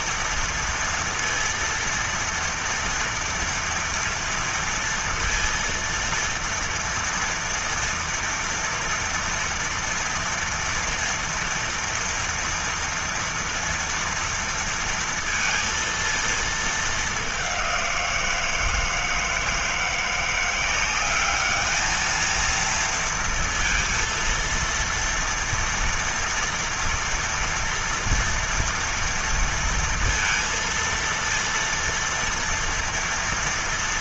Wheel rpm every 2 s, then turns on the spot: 230, 230, 230, 230, 230, 230, 230, 230, 220, 170, 180, 230, 230, 230, 230, 230, 240.
none